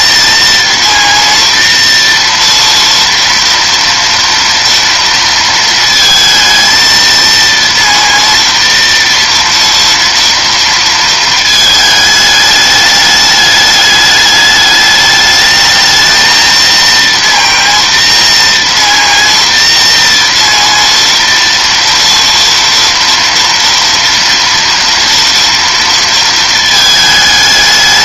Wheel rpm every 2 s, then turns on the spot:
230, 230, 230, 230, 230, 230, 210, 210, 230, 230, 230, 230, 240, 220.
none